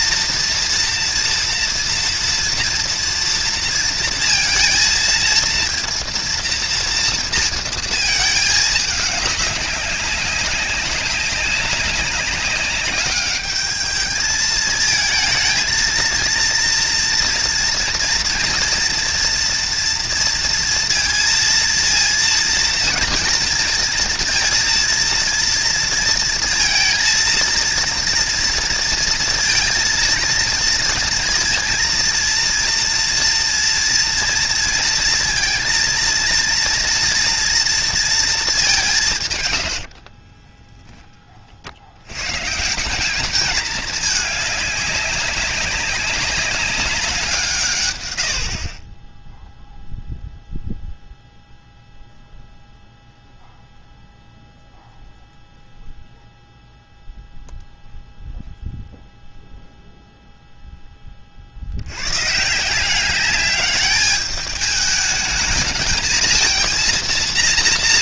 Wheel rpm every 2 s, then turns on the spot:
240, 230, 230, 230, 210, 200, 200, 220, 230, 230, 230, 230, 230, 230, 230, 230, 230, 230, 230, 180, 10, 160, 200, 200, 40, 0, 0, 0, 0, 0, 10, 160, 210, 230.
none